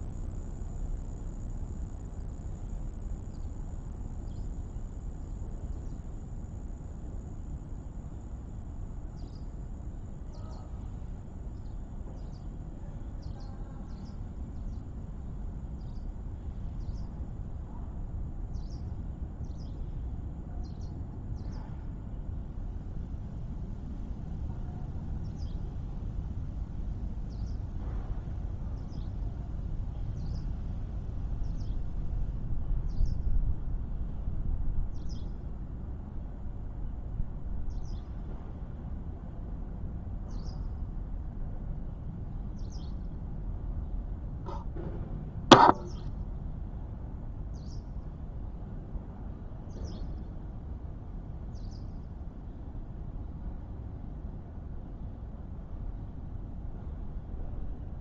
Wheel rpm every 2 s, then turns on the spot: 0, 0, 0, 0, 0, 0, 0, 0, 0, 0, 0, 0, 0, 0, 0, 0, 0, 0, 0, 0, 0, 0, 0, 0, 0, 0, 0, 0, 0.
none